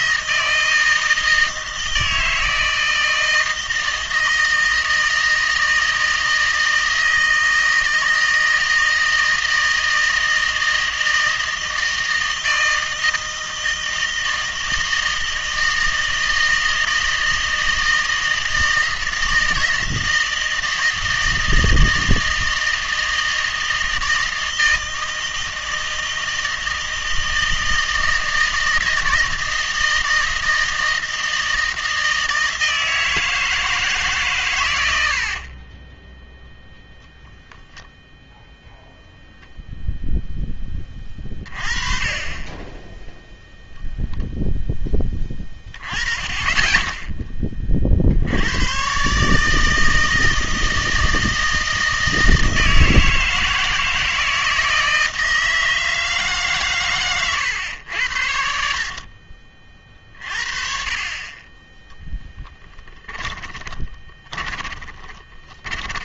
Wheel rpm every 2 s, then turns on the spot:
160, 160, 160, 160, 160, 160, 160, 160, 160, 160, 160, 160, 160, 160, 160, 160, 160, 100, 0, 0, 10, 20, 10, 20, 110, 160, 160, 160, 130, 60, 30, 10, 20.
58-60 62-66